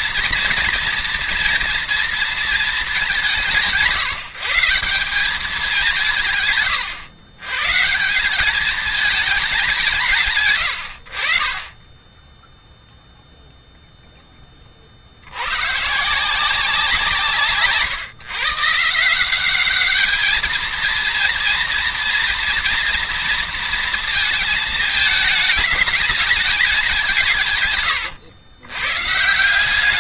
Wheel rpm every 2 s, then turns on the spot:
230, 210, 180, 120, 210, 80, 0, 50, 170, 150, 230, 230, 220, 190, 110.
none